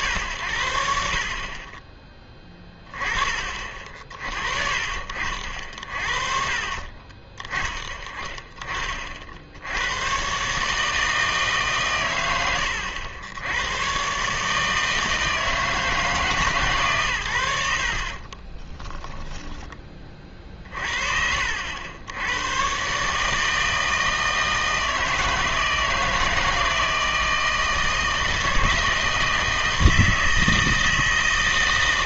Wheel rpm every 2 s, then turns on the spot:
60, 20, 50, 50, 30, 150, 90, 150, 150, 10, 40, 130, 160, 160, 160, 160.
2-4 18-20